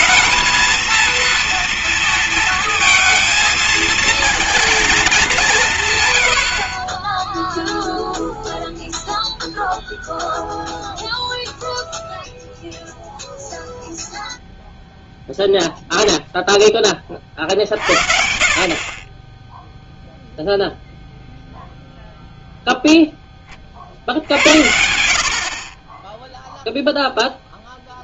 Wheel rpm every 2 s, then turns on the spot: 230, 230, 230, 80, 0, 0, 0, 0, 20, 50, 0, 0, 70, 0.
none